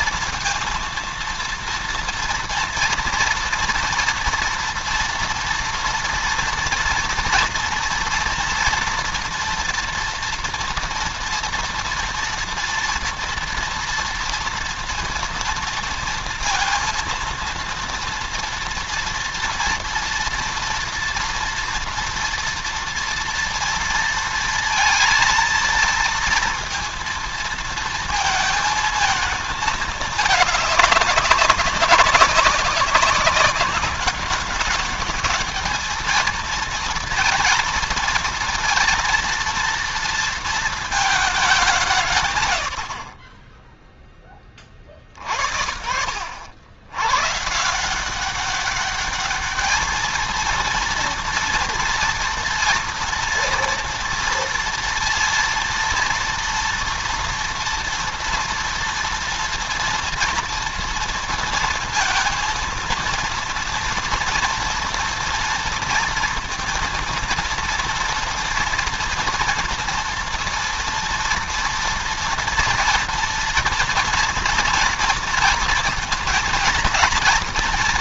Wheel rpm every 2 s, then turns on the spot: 230, 230, 230, 230, 230, 230, 230, 230, 230, 230, 240, 230, 230, 230, 220, 200, 190, 200, 230, 230, 220, 70, 40, 100, 200, 230, 230, 230, 230, 230, 230, 230, 230, 230, 230, 230, 230, 240, 220.
none